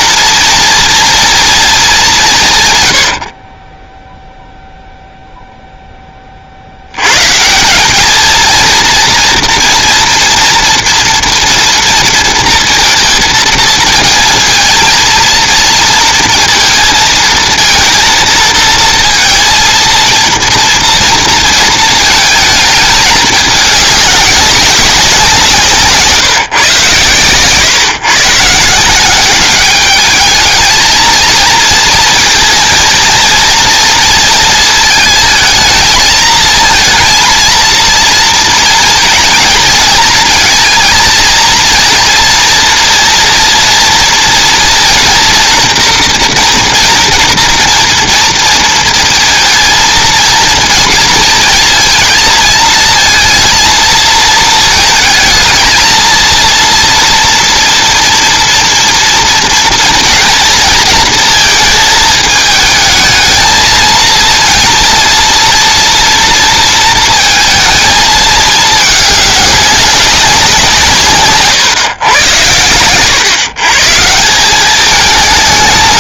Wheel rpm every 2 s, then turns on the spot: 230, 150, 0, 60, 230, 230, 230, 230, 230, 230, 240, 220, 200, 140, 160, 220, 230, 220, 220, 220, 230, 230, 240, 240, 230, 230, 230, 220, 230, 230, 230, 220, 230, 230, 210, 170, 120, 190.
none